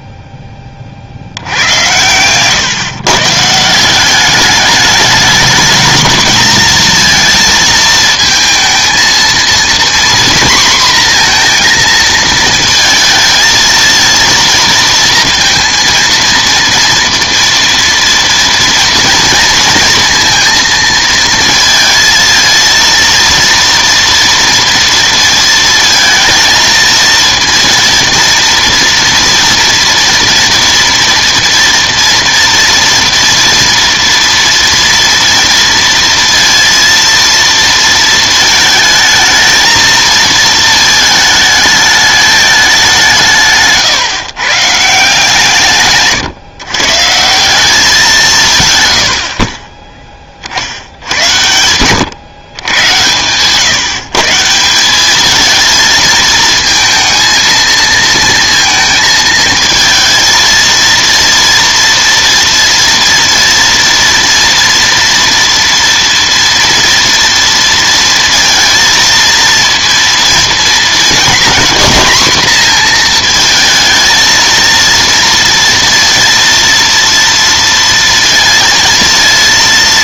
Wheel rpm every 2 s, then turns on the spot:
30, 130, 210, 220, 230, 240, 220, 230, 230, 230, 230, 230, 230, 230, 240, 240, 230, 230, 230, 220, 220, 200, 150, 140, 130, 70, 120, 170, 230, 230, 220, 230, 230, 230, 230, 230, 230, 230, 230, 230.
none